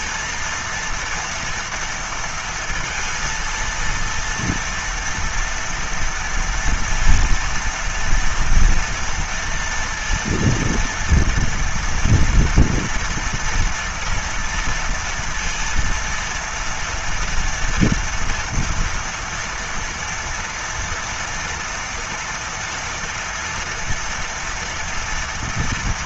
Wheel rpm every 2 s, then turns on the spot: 230, 230, 230, 230, 230, 230, 230, 230, 230, 240, 230, 230, 230.
none